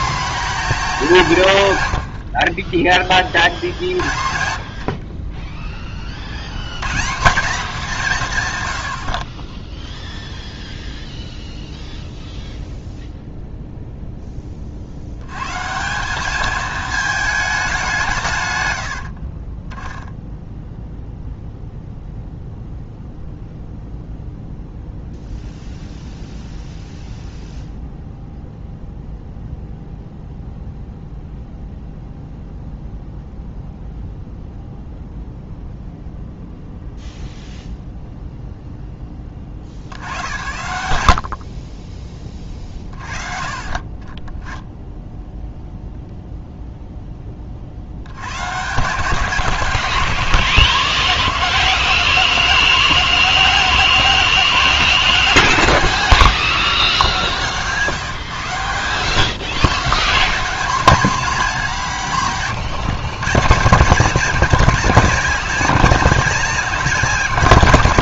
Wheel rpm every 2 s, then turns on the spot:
190, 30, 40, 160, 70, 0, 0, 80, 220, 60, 0, 0, 0, 0, 0, 0, 0, 0, 0, 10, 70, 40, 10, 0, 140, 160, 170, 160, 100, 130, 220, 150, 220, 200.
4-6 18-20